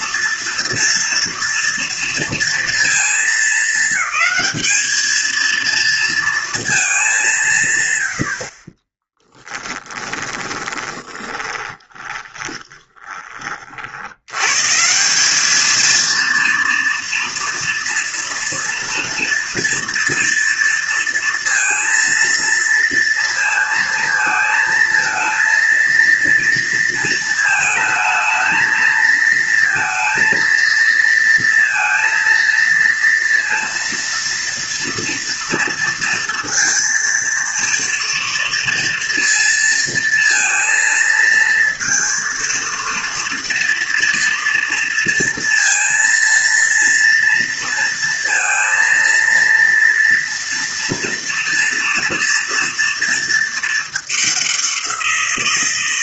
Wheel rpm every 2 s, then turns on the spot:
230, 230, 220, 210, 20, 20, 20, 160, 230, 230, 230, 230, 230, 230, 220, 230, 230, 230, 230, 230, 230, 230, 230, 230, 230, 230, 230, 180.
8-14